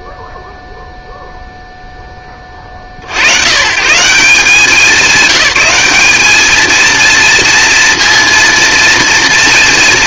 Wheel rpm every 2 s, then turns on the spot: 0, 70, 180, 230, 230.
none